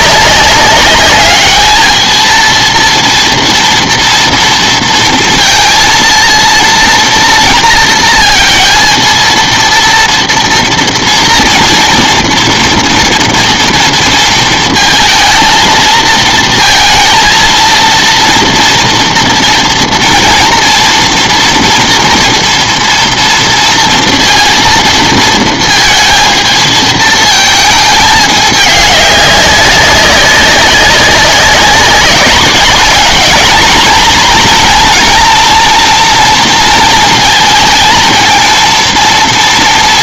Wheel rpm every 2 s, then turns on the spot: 200, 230, 230, 230, 230, 230, 230, 220, 230, 230, 230, 240, 230, 220, 210, 190, 210, 240, 230, 230.
none